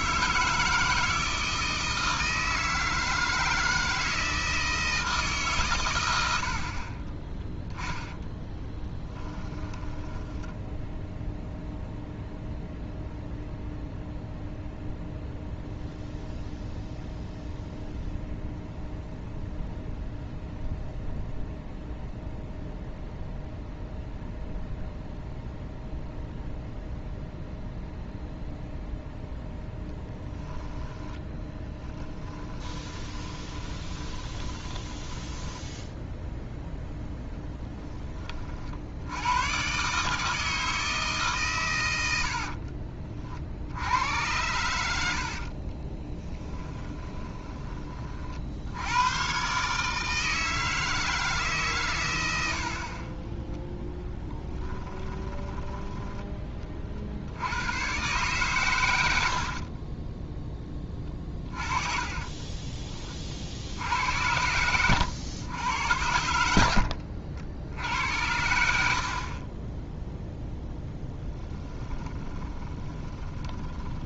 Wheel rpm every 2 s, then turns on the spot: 160, 160, 160, 40, 10, 0, 0, 0, 0, 0, 0, 0, 0, 0, 0, 10, 20, 10, 0, 70, 150, 30, 90, 10, 90, 160, 40, 20, 40, 100, 10, 20, 90, 70, 70, 0, 20.
8-10 30-36 46-48 54-56 66-68 72-74